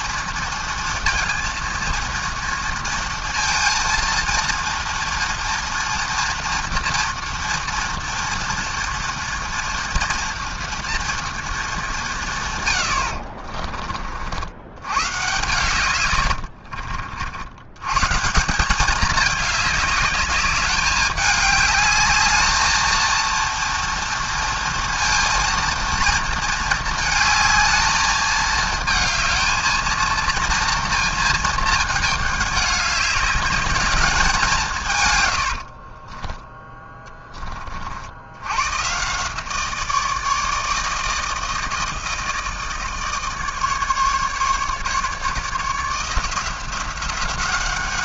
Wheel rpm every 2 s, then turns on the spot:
230, 230, 230, 240, 230, 230, 110, 110, 50, 190, 200, 220, 230, 220, 220, 230, 200, 160, 10, 120, 160, 160, 150, 180.
12-14